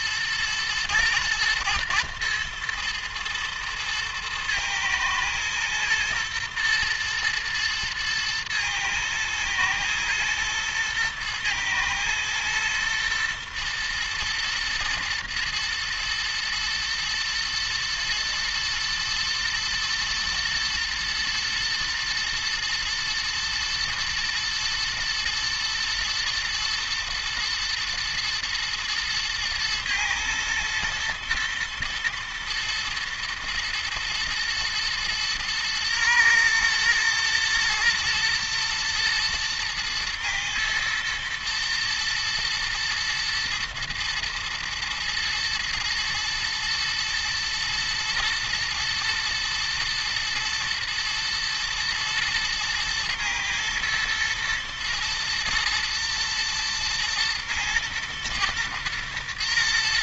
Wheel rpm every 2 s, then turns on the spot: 120, 120, 120, 110, 110, 110, 110, 110, 110, 110, 120, 120, 110, 110, 110, 110, 110, 120, 120, 110, 120, 120, 120, 110, 110, 120, 120, 120, 120, 110.
none